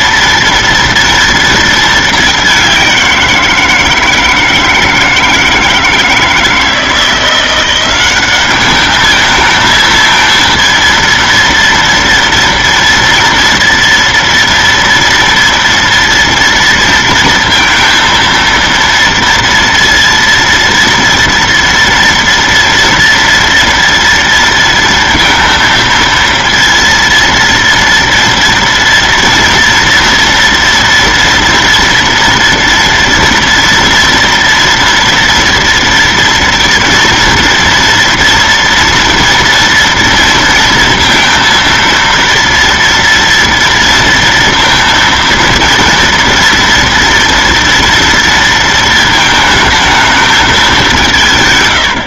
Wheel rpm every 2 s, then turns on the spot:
230, 190, 160, 160, 210, 230, 240, 230, 230, 230, 230, 230, 230, 230, 230, 230, 230, 230, 230, 230, 230, 230, 230, 230, 230, 200.
none